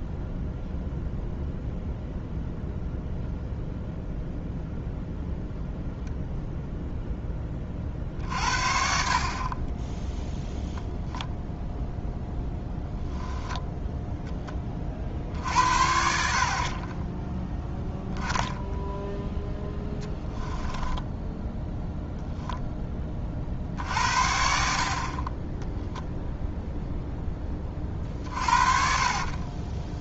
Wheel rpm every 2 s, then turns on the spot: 0, 0, 0, 0, 50, 0, 10, 40, 30, 0, 10, 10, 60, 0, 40.
20-22 28-30